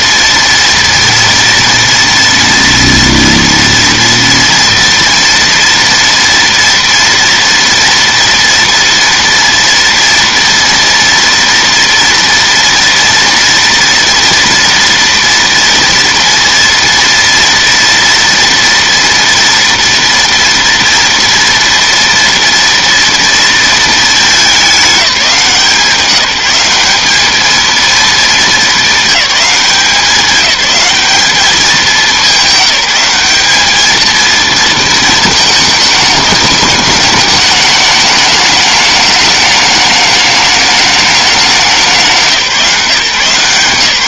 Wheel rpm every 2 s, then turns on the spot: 230, 230, 230, 230, 230, 230, 230, 230, 230, 230, 240, 230, 180, 200, 200, 210, 190, 220, 210, 210, 210, 180.
none